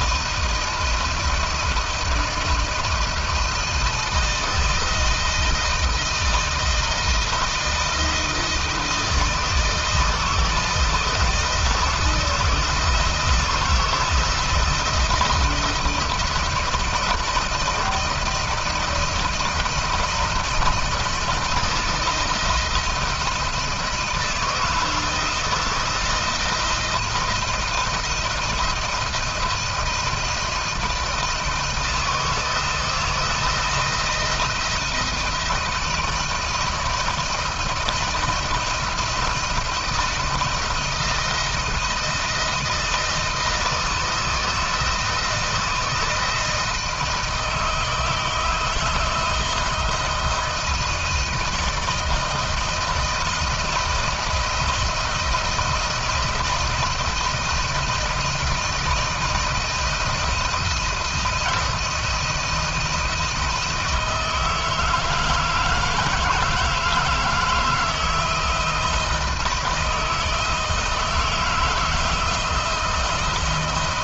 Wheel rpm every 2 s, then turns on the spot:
170, 170, 160, 160, 160, 160, 160, 160, 160, 160, 160, 160, 160, 160, 160, 160, 160, 160, 160, 170, 170, 160, 160, 160, 160, 160, 160, 170, 160, 160, 170, 160, 160, 160, 160, 160, 160.
none